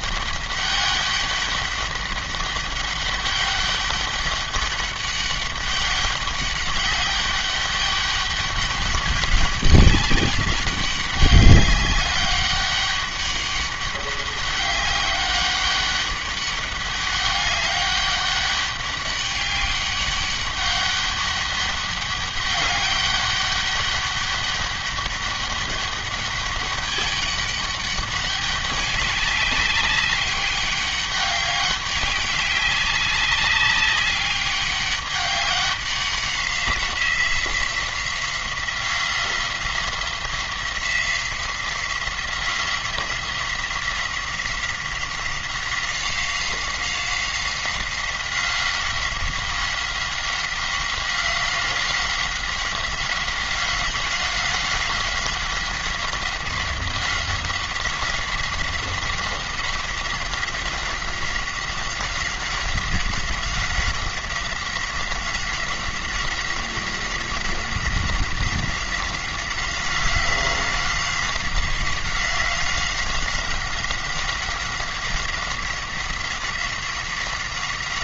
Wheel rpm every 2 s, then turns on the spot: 200, 200, 200, 200, 200, 200, 200, 190, 200, 200, 200, 200, 200, 200, 200, 200, 200, 200, 180, 180, 180, 180, 180, 190, 190, 190, 190, 190, 190, 180, 190, 190, 180, 190, 190, 190, 190, 190, 190.
none